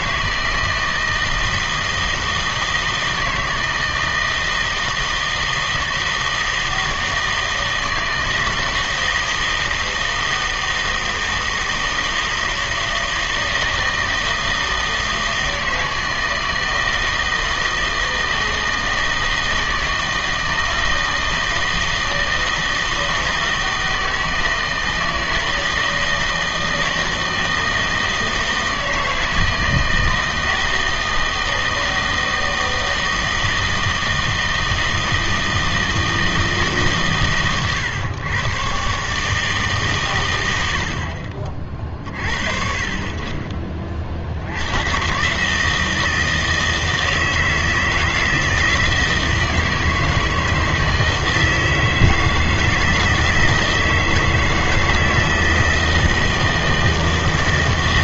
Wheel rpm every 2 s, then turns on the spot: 160, 160, 160, 160, 160, 160, 160, 160, 160, 160, 160, 160, 160, 160, 160, 160, 160, 160, 150, 130, 80, 40, 90, 160, 160, 160, 160, 160, 160.
none